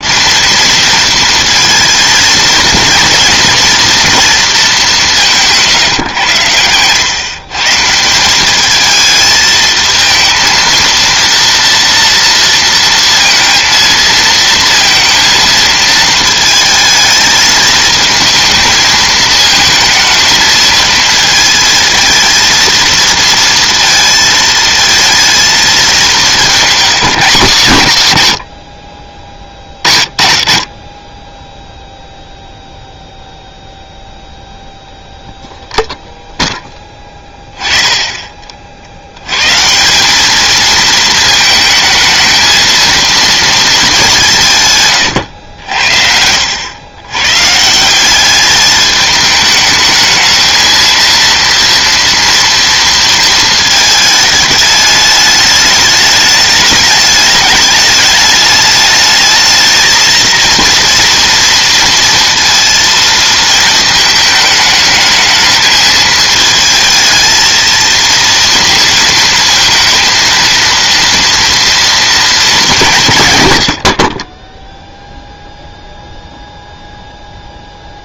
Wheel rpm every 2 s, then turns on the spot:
230, 230, 210, 110, 210, 230, 230, 230, 220, 220, 220, 230, 230, 210, 90, 30, 0, 0, 10, 50, 220, 220, 140, 90, 210, 220, 230, 210, 210, 210, 230, 230, 220, 220, 230, 230, 200, 10, 0.
none